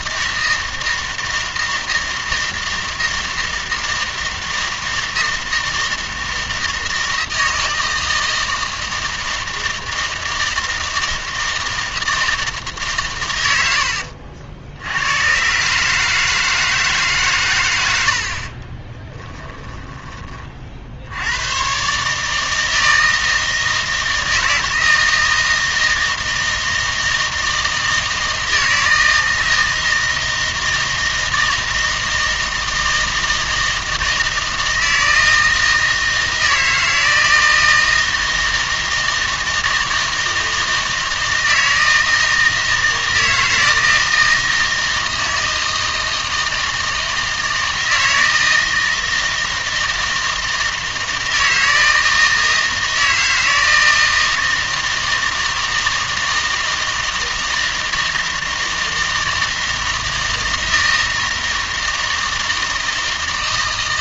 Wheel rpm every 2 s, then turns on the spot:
160, 160, 160, 160, 160, 160, 150, 80, 160, 30, 40, 160, 160, 160, 160, 160, 160, 160, 160, 160, 160, 160, 160, 160, 160, 160, 160, 160, 160, 160, 160, 160.
18-20